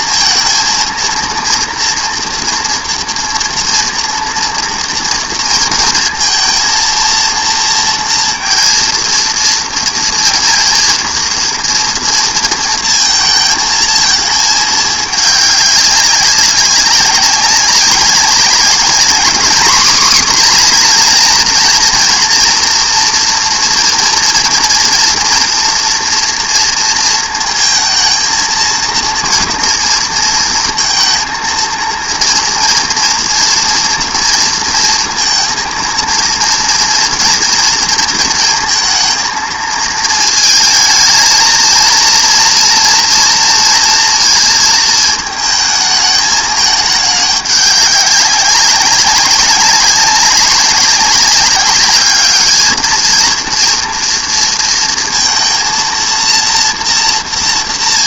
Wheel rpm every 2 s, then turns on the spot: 230, 230, 230, 230, 230, 230, 230, 210, 190, 210, 250, 240, 240, 230, 230, 230, 230, 230, 230, 230, 220, 230, 220, 210, 200, 200, 220, 230, 230.
none